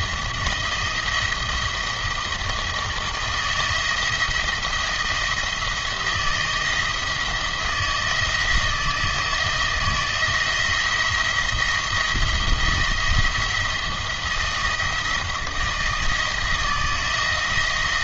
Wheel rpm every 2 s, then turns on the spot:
160, 160, 160, 170, 170, 170, 170, 170, 160.
none